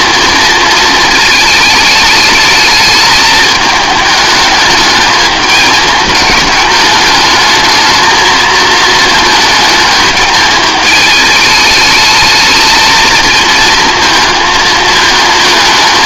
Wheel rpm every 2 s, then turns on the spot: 220, 220, 220, 210, 220, 220, 220, 220.
none